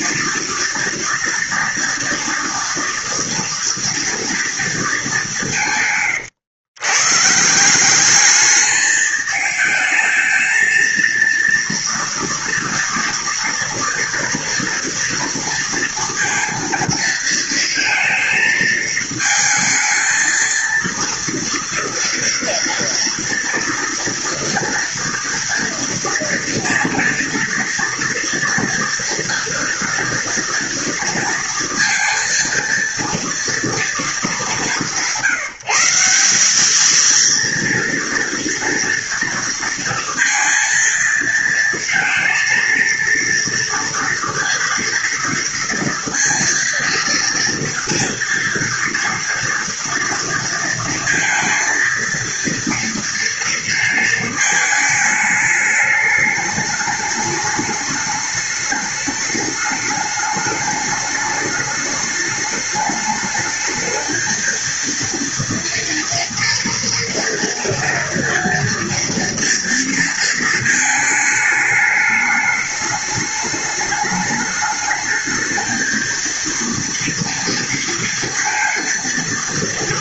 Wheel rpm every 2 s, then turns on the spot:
230, 230, 230, 110, 210, 220, 230, 230, 230, 230, 230, 240, 230, 240, 230, 230, 230, 200, 200, 230, 230, 230, 230, 230, 230, 230, 230, 220, 210, 210, 210, 210, 230, 230, 230, 220, 210, 220, 230, 230.
none